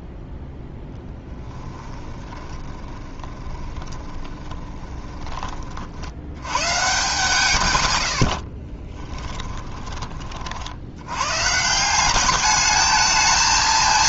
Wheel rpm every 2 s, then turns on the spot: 0, 30, 20, 130, 30, 70, 210.
2-6 8-10